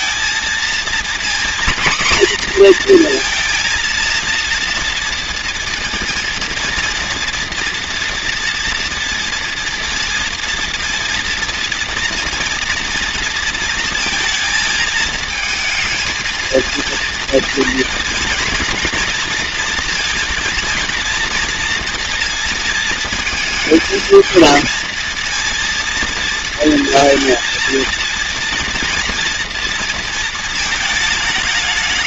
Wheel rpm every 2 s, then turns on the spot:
230, 240, 230, 230, 240, 230, 240, 220, 230, 230, 230, 230, 230, 230, 230, 190.
none